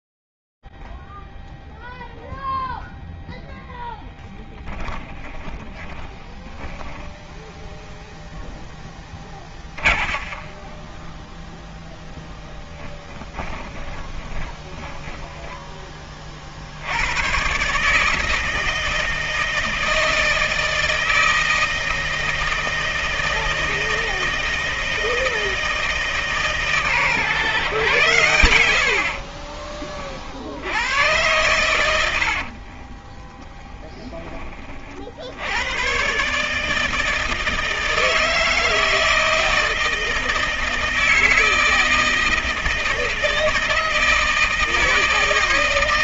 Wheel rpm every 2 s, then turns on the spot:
0, 0, 10, 20, 0, 20, 10, 20, 90, 160, 160, 160, 160, 140, 60, 90, 50, 40, 150, 160, 160, 160, 160.
4-8 10-16 28-30 32-34